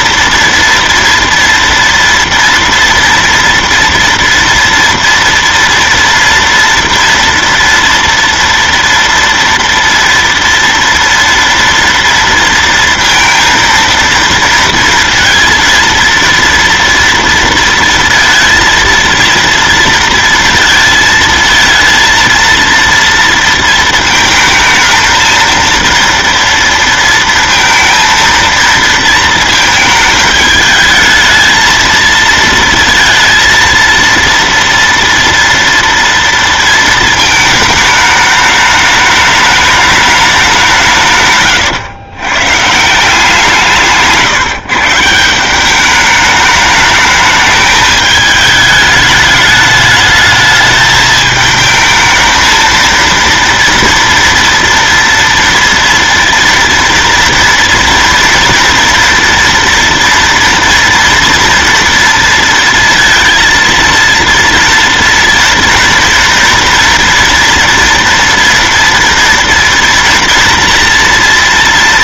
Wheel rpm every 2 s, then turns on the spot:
230, 230, 230, 240, 230, 230, 230, 230, 230, 230, 230, 230, 220, 230, 230, 210, 230, 230, 230, 210, 190, 140, 130, 210, 210, 220, 220, 230, 230, 240, 230, 230, 230, 230, 230, 230.
none